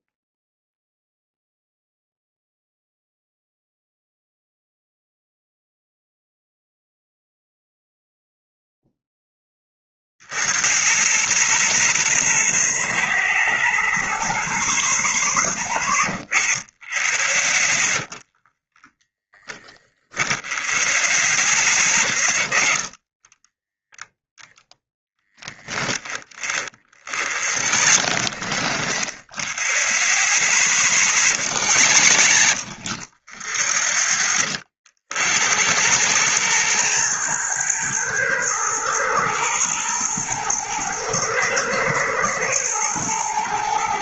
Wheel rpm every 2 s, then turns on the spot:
0, 0, 0, 0, 0, 90, 40, 10, 20, 20, 10, 20, 0, 30, 30, 30, 40, 40, 110, 110, 110, 110.
18-20 26-30 32-34